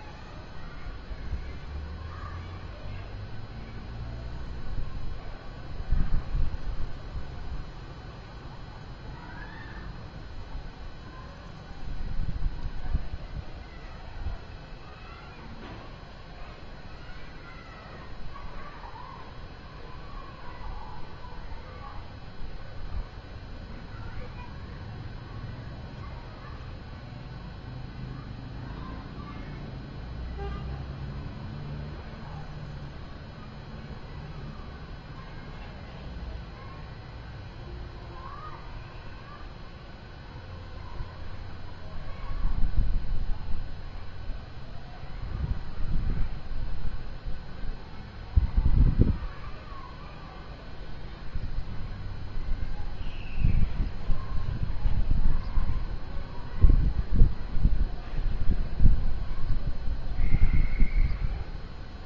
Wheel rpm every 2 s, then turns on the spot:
0, 0, 0, 0, 0, 0, 0, 0, 0, 0, 0, 0, 0, 0, 0, 0, 0, 0, 0, 0, 0, 0, 0, 0, 0, 0, 0, 0, 0, 0, 0.
none